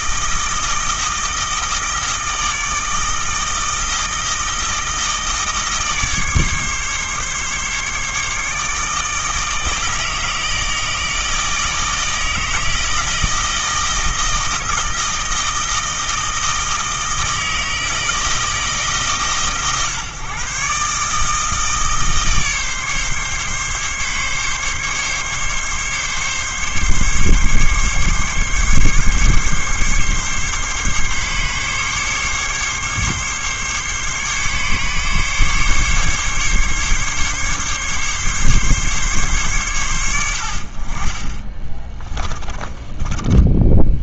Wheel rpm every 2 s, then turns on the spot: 160, 160, 160, 140, 150, 160, 160, 160, 160, 160, 140, 140, 140, 140, 140, 140, 140, 140, 140, 140, 40, 20.
42-44